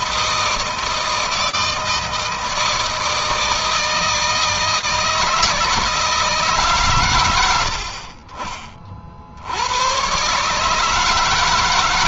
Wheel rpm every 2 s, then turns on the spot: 160, 160, 160, 110, 50, 150.
none